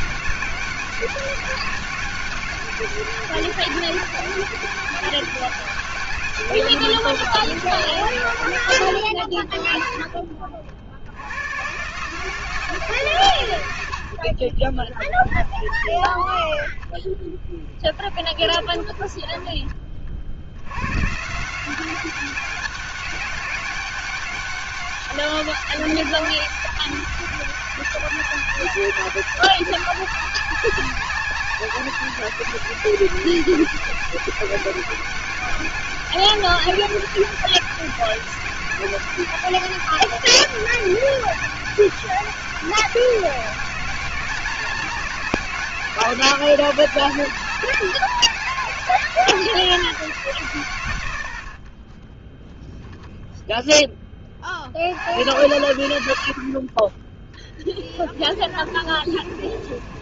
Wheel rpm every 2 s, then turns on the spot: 200, 190, 200, 200, 90, 70, 150, 20, 10, 30, 130, 200, 200, 200, 200, 200, 200, 200, 190, 200, 200, 190, 190, 200, 190, 120, 10, 80, 20, 40.
14-20 58-60